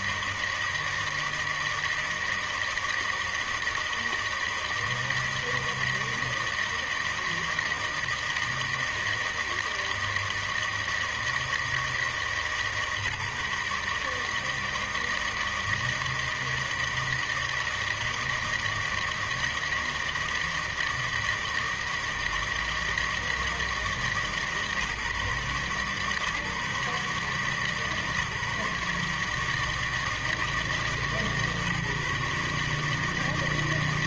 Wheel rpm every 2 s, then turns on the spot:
160, 160, 160, 160, 160, 160, 160, 150, 160, 160, 160, 160, 150, 140, 150, 160, 150.
none